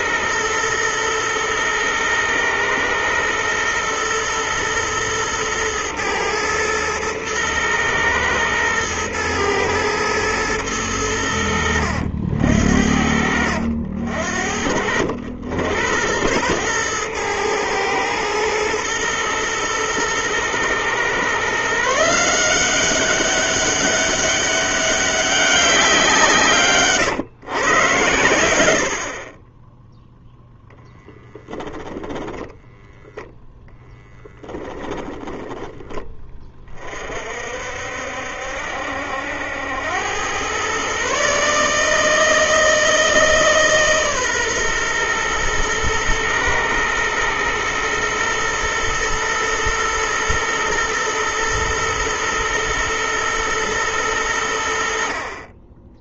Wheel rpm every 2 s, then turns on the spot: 120, 120, 110, 110, 120, 100, 70, 70, 110, 120, 120, 190, 200, 130, 60, 0, 0, 10, 40, 70, 130, 160, 120, 110, 120, 120, 120, 60.
34-36